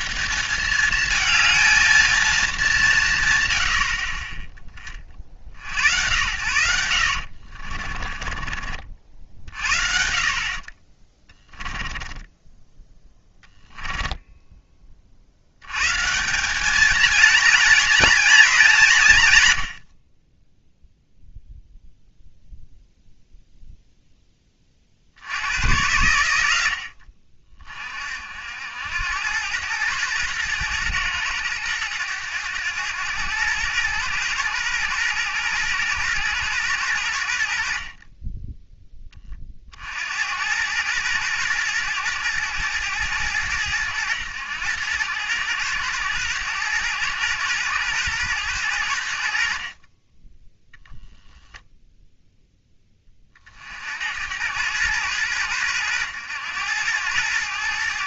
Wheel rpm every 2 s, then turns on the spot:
210, 190, 20, 80, 40, 30, 10, 20, 220, 190, 0, 0, 40, 70, 80, 110, 100, 110, 110, 10, 100, 100, 90, 110, 90, 0, 20, 100, 100.
6-8 10-14